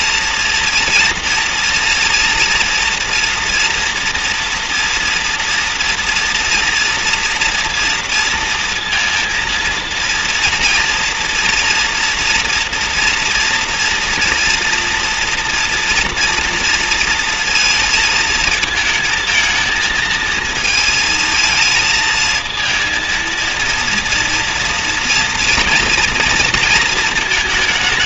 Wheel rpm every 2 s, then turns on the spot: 230, 230, 230, 230, 230, 230, 240, 240, 230, 220, 230, 230, 230, 230.
none